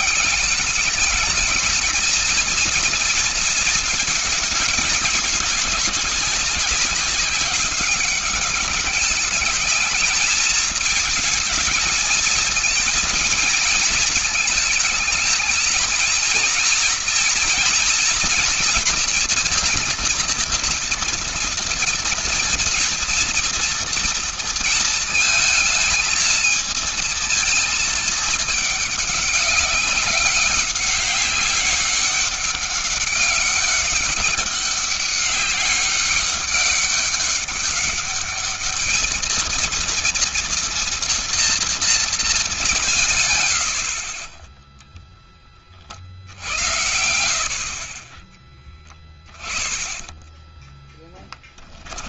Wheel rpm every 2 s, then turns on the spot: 180, 230, 220, 190, 210, 220, 230, 220, 240, 240, 240, 230, 230, 220, 220, 200, 200, 200, 200, 210, 230, 170, 10, 70, 10, 10.
48-50